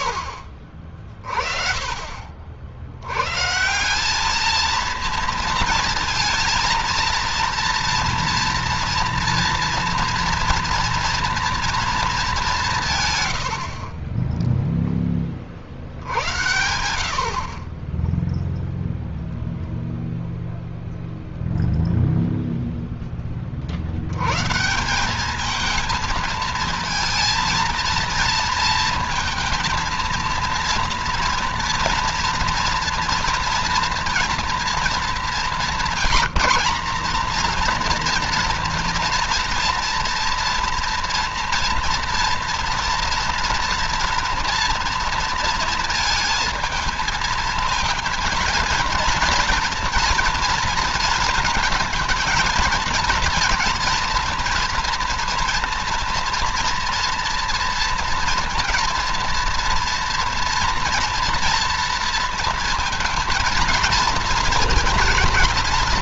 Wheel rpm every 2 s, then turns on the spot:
30, 40, 210, 230, 230, 230, 210, 10, 70, 0, 0, 0, 120, 220, 230, 230, 240, 240, 200, 230, 230, 230, 230, 230, 230, 230, 220, 230, 230, 230, 230, 230, 230.
14-16